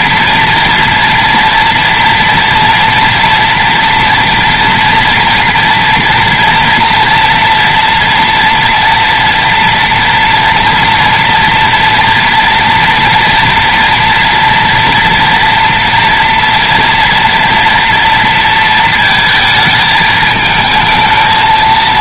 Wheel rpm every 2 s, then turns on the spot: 230, 230, 240, 230, 230, 240, 230, 230, 230, 230, 220.
none